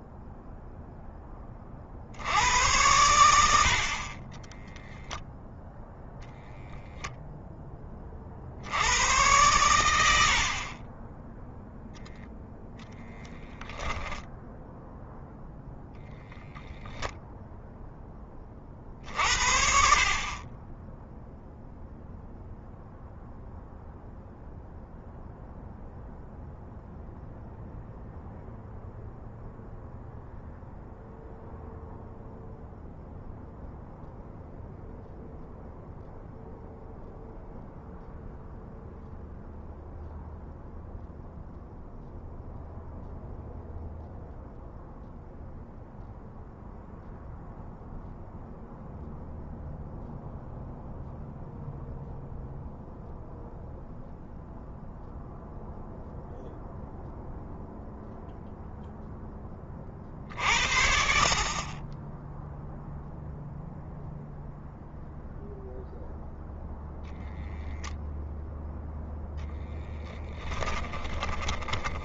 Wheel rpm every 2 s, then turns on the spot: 0, 90, 10, 0, 90, 30, 0, 0, 0, 40, 10, 0, 0, 0, 0, 0, 0, 0, 0, 0, 0, 0, 0, 0, 0, 0, 0, 0, 0, 10, 70, 0, 0, 0, 10, 20.
4-6 70-72